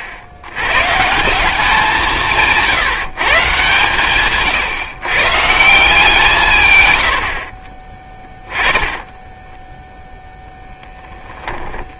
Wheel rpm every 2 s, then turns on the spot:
90, 160, 140, 130, 20, 10.
8-10